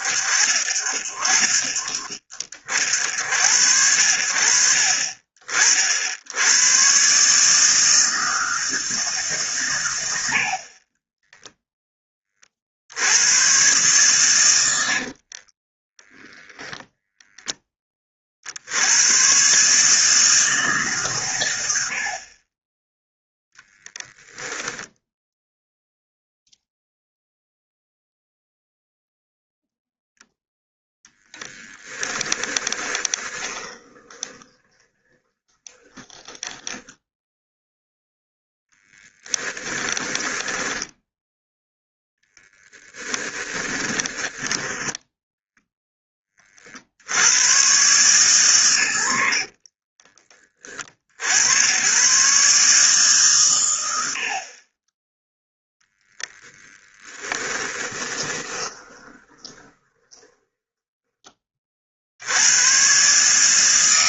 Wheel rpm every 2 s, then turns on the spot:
50, 60, 50, 120, 160, 20, 70, 70, 0, 90, 140, 10, 10, 0, 0, 0, 20, 20, 10, 10, 10, 10, 10, 40, 100, 40, 140, 20, 10, 20, 10, 130.
14-16 32-46 56-62